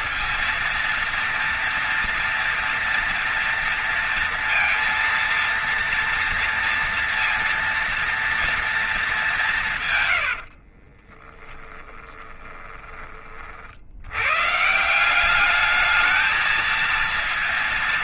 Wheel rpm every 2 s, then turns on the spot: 230, 230, 230, 230, 230, 90, 10, 120, 220.
10-12